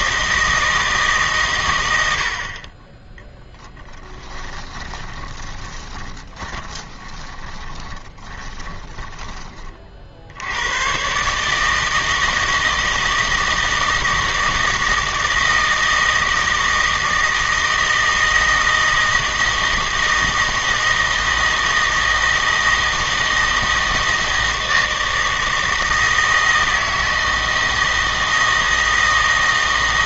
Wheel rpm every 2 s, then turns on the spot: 160, 20, 20, 20, 10, 110, 160, 160, 160, 160, 160, 160, 160, 160, 160.
4-10